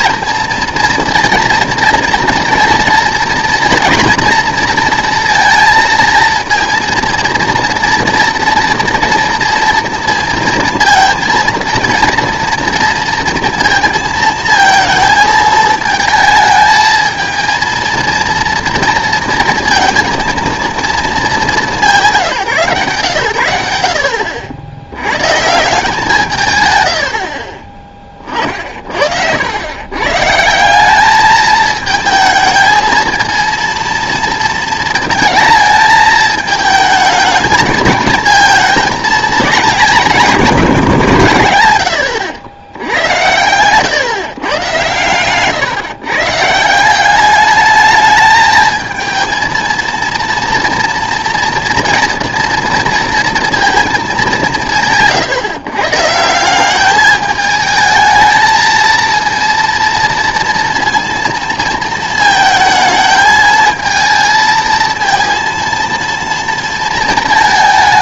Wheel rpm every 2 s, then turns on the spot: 230, 240, 230, 230, 230, 230, 230, 220, 220, 230, 230, 140, 70, 130, 40, 170, 220, 230, 220, 230, 170, 80, 130, 160, 220, 230, 230, 180, 190, 220, 230, 220, 220, 230.
none